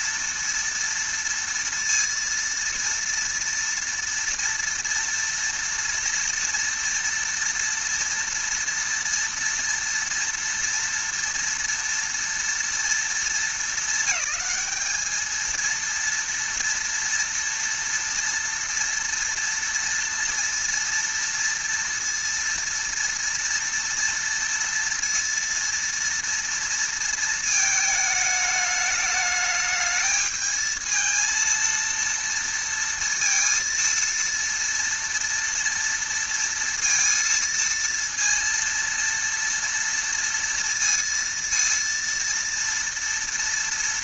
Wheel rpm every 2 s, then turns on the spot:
230, 230, 240, 230, 230, 230, 230, 200, 230, 230, 230, 230, 240, 230, 210, 220, 230, 230, 230, 230, 230, 230.
none